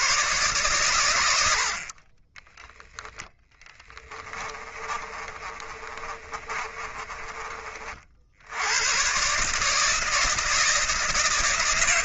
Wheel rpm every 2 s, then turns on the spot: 130, 10, 20, 30, 100, 160.
2-8